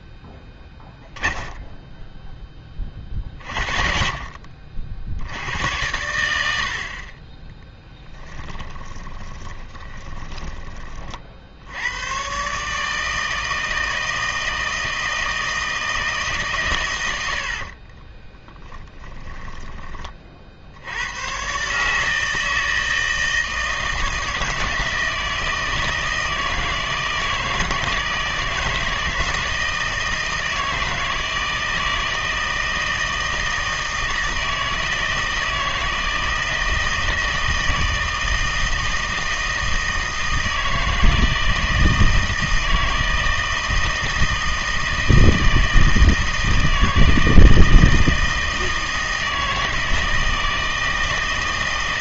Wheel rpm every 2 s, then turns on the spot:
10, 30, 50, 70, 20, 20, 150, 160, 130, 10, 70, 160, 160, 160, 160, 160, 160, 160, 160, 160, 160, 160, 160, 160, 160, 160.
8-10 18-20